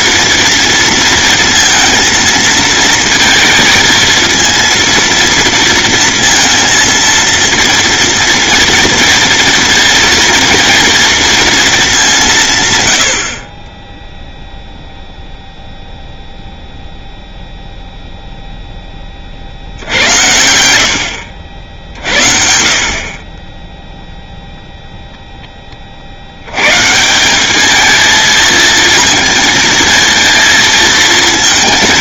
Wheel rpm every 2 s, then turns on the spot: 240, 220, 230, 230, 230, 230, 140, 0, 0, 0, 80, 50, 0, 90, 230, 230.
none